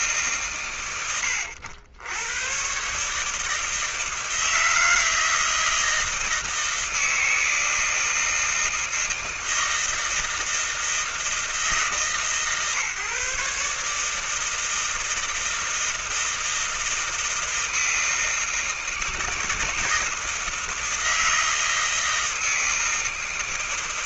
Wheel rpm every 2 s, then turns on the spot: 150, 90, 160, 160, 160, 160, 140, 150, 160, 160, 160, 160.
none